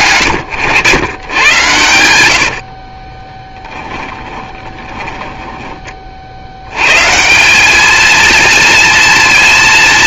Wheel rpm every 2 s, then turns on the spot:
120, 60, 10, 100, 230.
2-6